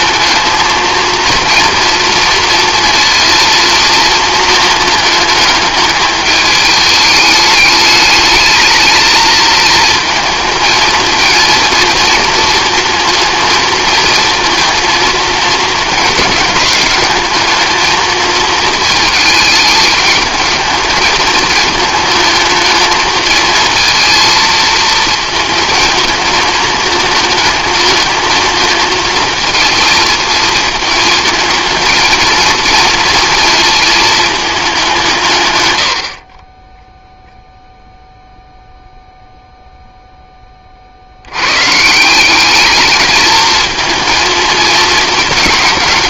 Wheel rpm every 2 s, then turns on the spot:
220, 230, 220, 210, 220, 230, 230, 230, 210, 220, 220, 220, 230, 220, 220, 220, 220, 190, 10, 0, 40, 200, 230.
none